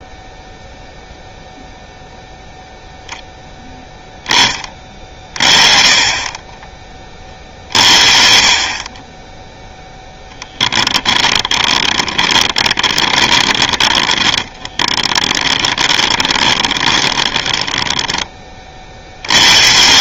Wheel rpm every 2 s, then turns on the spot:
0, 0, 30, 30, 40, 10, 20, 20, 20, 30.
10-18